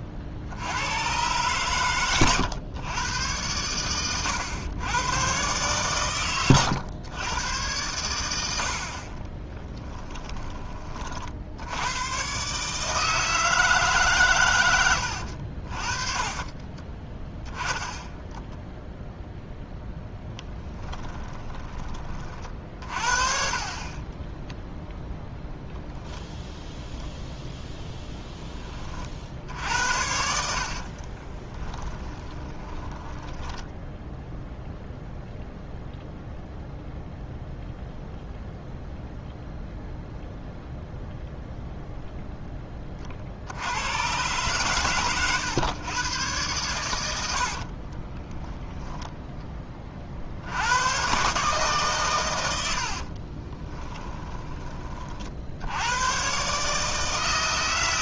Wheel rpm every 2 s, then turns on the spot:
60, 120, 110, 110, 70, 30, 150, 110, 30, 10, 10, 40, 0, 0, 20, 60, 20, 0, 0, 0, 0, 20, 130, 110, 10, 90, 80, 20, 150.
14-18 20-22 30-34